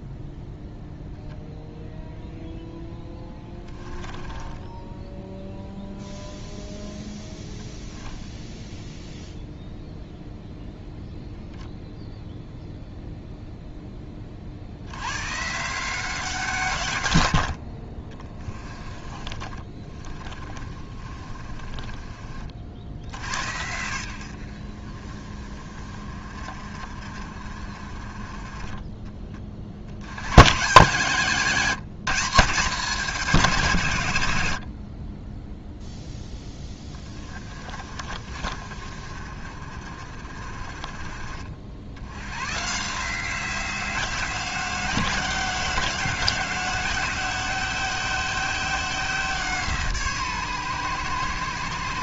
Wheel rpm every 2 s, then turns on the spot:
0, 10, 10, 0, 0, 0, 0, 90, 140, 20, 30, 80, 50, 40, 30, 150, 190, 40, 20, 40, 40, 150, 180, 190, 180, 120.
2-6 18-22 34-36